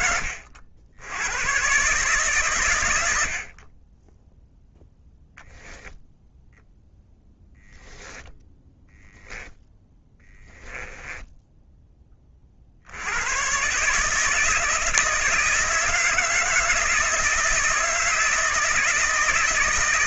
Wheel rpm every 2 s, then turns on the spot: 60, 100, 0, 0, 0, 10, 70, 160, 160, 160.
10-12